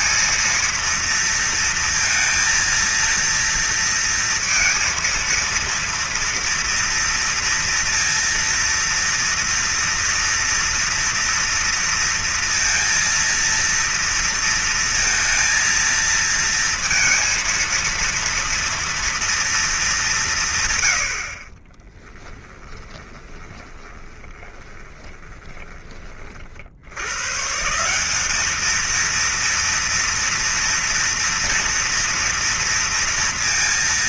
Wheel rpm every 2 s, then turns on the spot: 230, 230, 230, 230, 230, 230, 230, 230, 230, 230, 90, 20, 20, 90, 220, 230, 230.
22-26